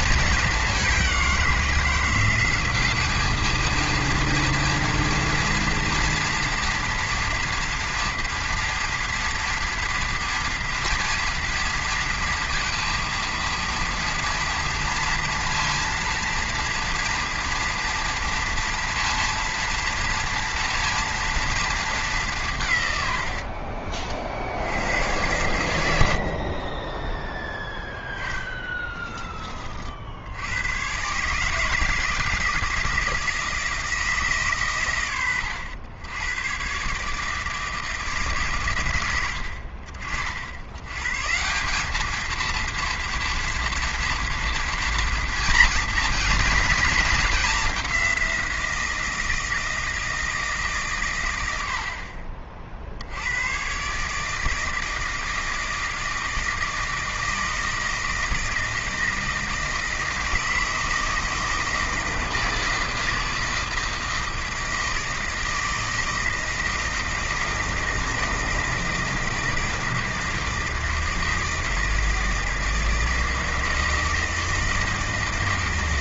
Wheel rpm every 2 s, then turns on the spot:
200, 190, 230, 240, 230, 230, 230, 230, 230, 230, 230, 150, 90, 30, 20, 100, 160, 130, 130, 130, 90, 230, 230, 230, 170, 150, 40, 160, 160, 160, 160, 160, 160, 160, 160, 160, 160, 160.
26-30